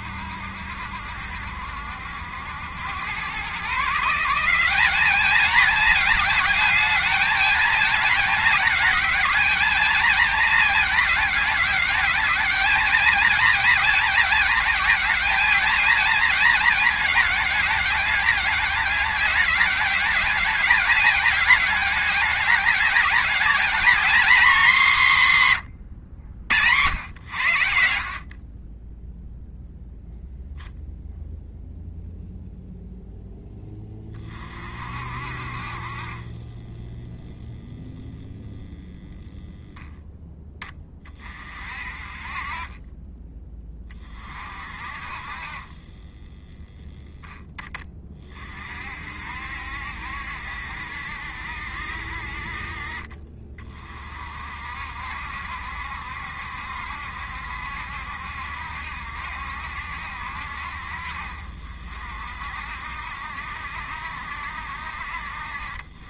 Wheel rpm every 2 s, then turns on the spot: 70, 100, 190, 210, 210, 210, 220, 220, 210, 200, 210, 210, 200, 100, 10, 0, 0, 50, 10, 0, 20, 30, 40, 0, 50, 70, 40, 60, 70, 70, 60, 60, 60.
none